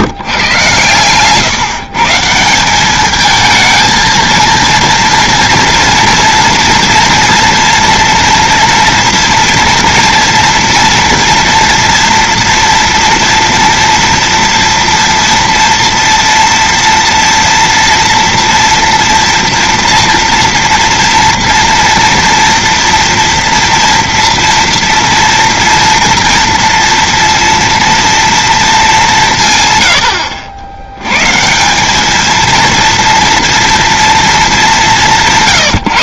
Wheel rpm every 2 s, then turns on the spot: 160, 150, 230, 230, 230, 240, 230, 230, 230, 230, 230, 230, 230, 230, 230, 90, 200, 230.
none